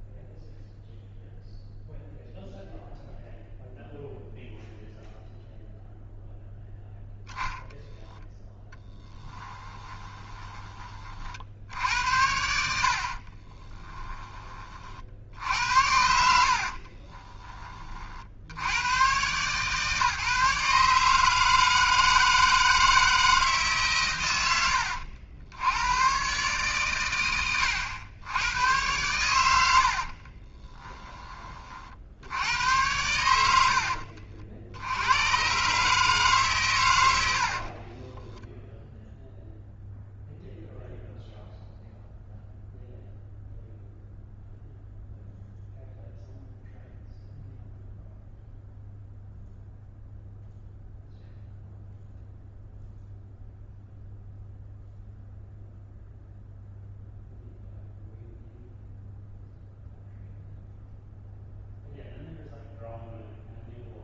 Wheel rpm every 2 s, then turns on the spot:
0, 0, 0, 0, 10, 30, 70, 40, 40, 100, 150, 160, 90, 130, 100, 10, 100, 50, 110, 10, 0, 0, 0, 0, 0, 0, 0, 0, 0, 0, 0, 0.
8-10 12-14 16-18 24-26 30-32